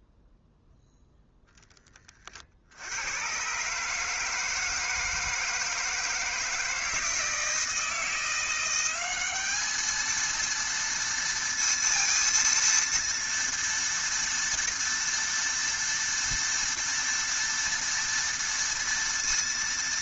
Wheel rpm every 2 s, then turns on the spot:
0, 60, 160, 160, 180, 230, 230, 230, 230, 230.
none